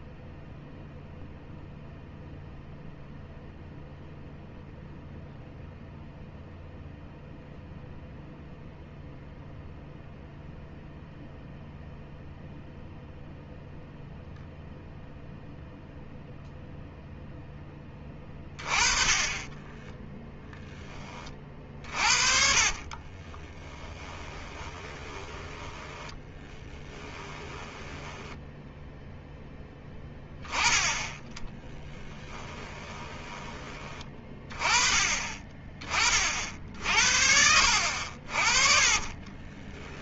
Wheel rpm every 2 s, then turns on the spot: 0, 0, 0, 0, 0, 0, 0, 0, 0, 30, 10, 50, 20, 20, 10, 10, 10, 30, 50, 40.
22-30 32-34 36-40